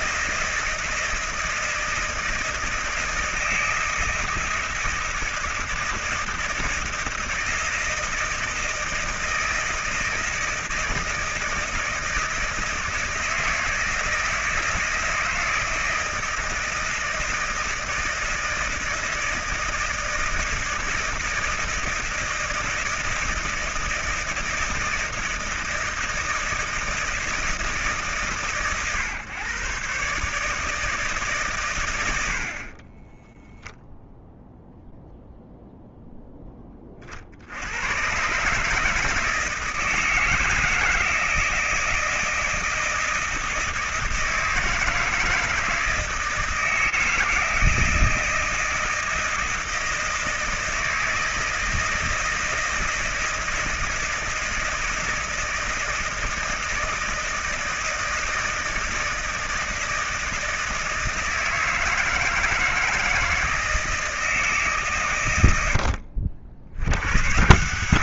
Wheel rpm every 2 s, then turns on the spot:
160, 160, 160, 160, 160, 160, 160, 160, 160, 160, 160, 160, 160, 160, 130, 150, 30, 0, 30, 150, 160, 160, 160, 160, 160, 160, 160, 160, 160, 160, 160, 160, 140, 80.
none